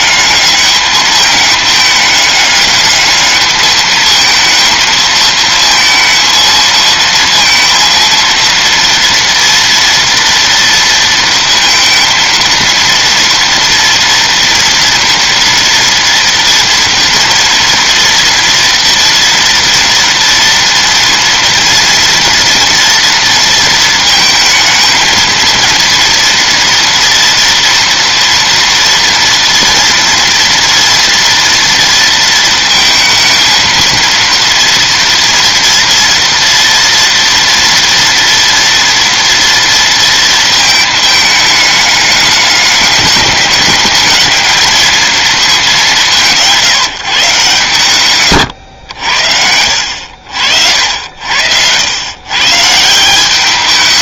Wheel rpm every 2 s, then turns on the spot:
210, 210, 220, 220, 230, 230, 230, 230, 230, 230, 230, 230, 220, 230, 230, 230, 230, 230, 240, 230, 220, 210, 220, 170, 110, 70, 150.
none